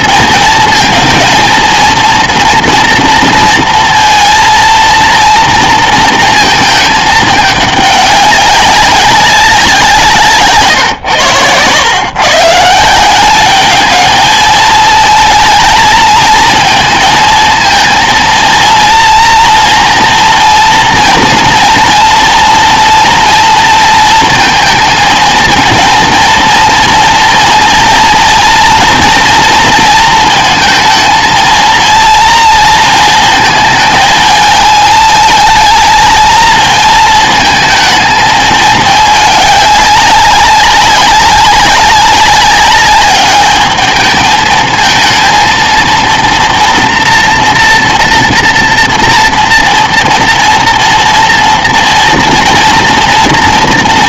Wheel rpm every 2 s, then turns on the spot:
220, 230, 230, 220, 200, 140, 160, 220, 220, 230, 230, 230, 230, 230, 240, 230, 230, 220, 220, 210, 200, 200, 220, 240, 230, 240, 230.
none